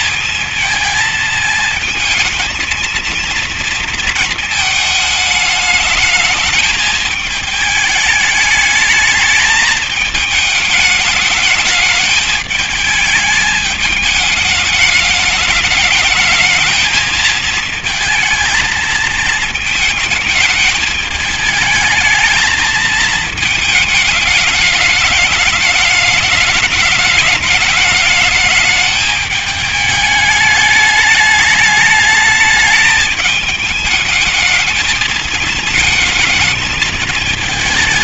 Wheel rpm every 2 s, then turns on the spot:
220, 220, 220, 210, 210, 210, 210, 210, 220, 220, 220, 220, 210, 210, 210, 210, 220, 220, 220.
none